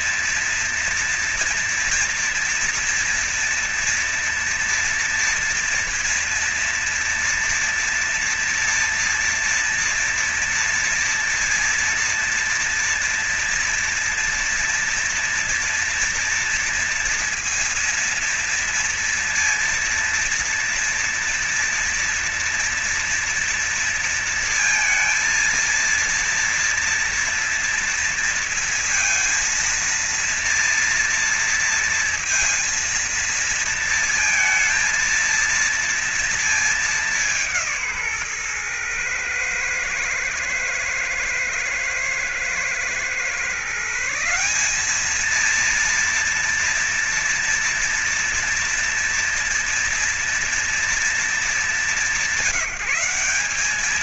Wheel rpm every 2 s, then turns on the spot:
230, 230, 230, 240, 240, 230, 230, 230, 230, 230, 230, 230, 230, 230, 230, 230, 230, 230, 230, 140, 120, 120, 160, 230, 230, 230, 190.
none